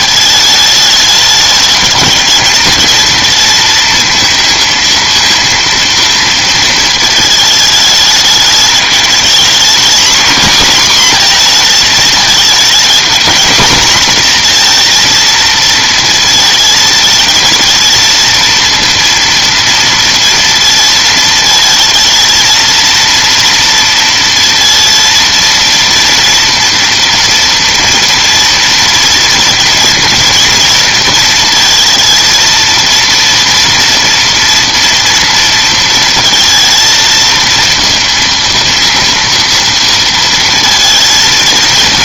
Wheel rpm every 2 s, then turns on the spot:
220, 230, 220, 220, 210, 240, 230, 240, 220, 230, 230, 230, 230, 230, 230, 230, 230, 230, 230, 230, 230.
none